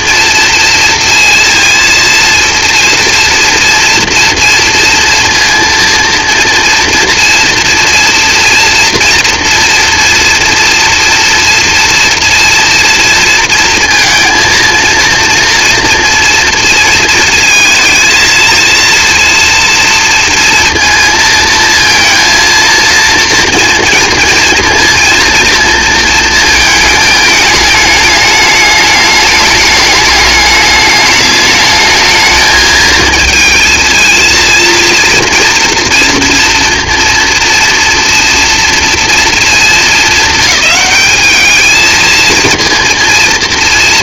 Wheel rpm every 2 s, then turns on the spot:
230, 230, 240, 230, 230, 230, 240, 230, 230, 230, 230, 230, 230, 220, 210, 210, 220, 230, 230, 230, 200, 230.
none